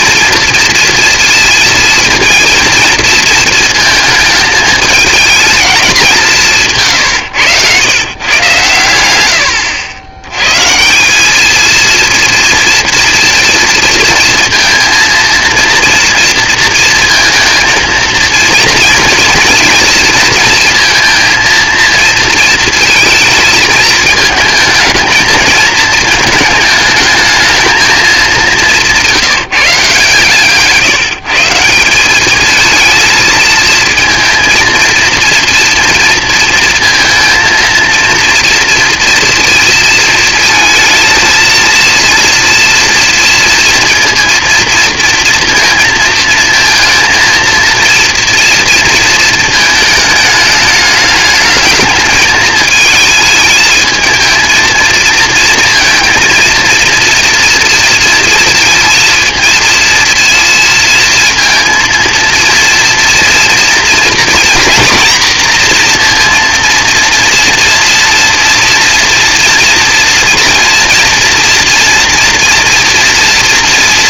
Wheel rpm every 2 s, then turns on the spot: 230, 230, 220, 160, 110, 130, 230, 230, 230, 230, 230, 230, 220, 220, 190, 140, 220, 230, 230, 230, 230, 230, 230, 230, 230, 210, 210, 230, 230, 230, 230, 230, 230, 230, 230, 230, 230.
28-30